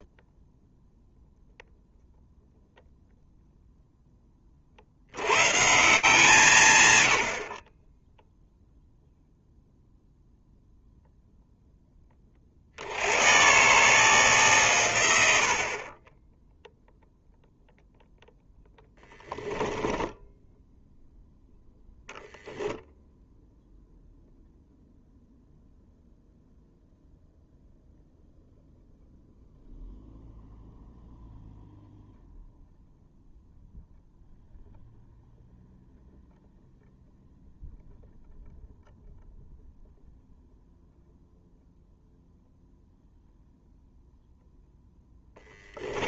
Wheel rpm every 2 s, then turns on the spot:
0, 0, 40, 130, 0, 0, 70, 130, 0, 10, 0, 0, 0, 0, 0, 0, 0, 0, 0, 0, 0, 0, 0.
none